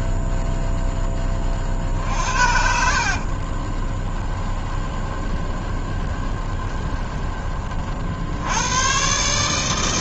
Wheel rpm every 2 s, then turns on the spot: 0, 70, 20, 20, 90.
2-8